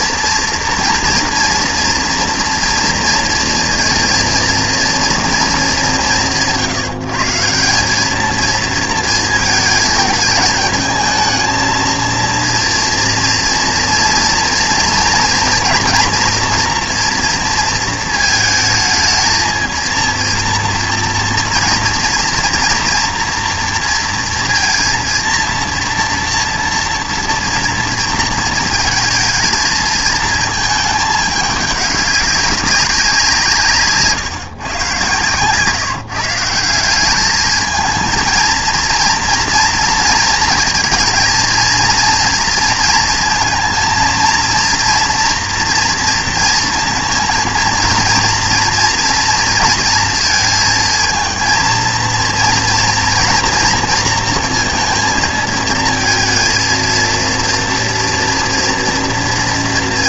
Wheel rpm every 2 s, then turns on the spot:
230, 230, 230, 150, 230, 220, 230, 230, 240, 220, 230, 240, 230, 230, 220, 220, 190, 130, 190, 230, 230, 230, 230, 230, 230, 230, 230, 230, 230, 240.
none